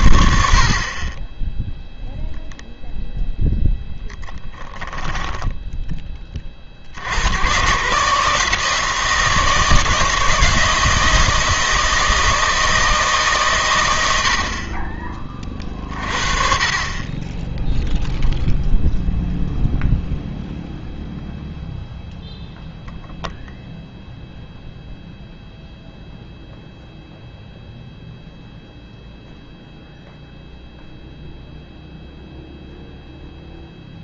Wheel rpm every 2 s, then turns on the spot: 50, 0, 10, 50, 160, 160, 160, 50, 40, 0, 0, 0, 0, 0, 0, 0, 0.
4-6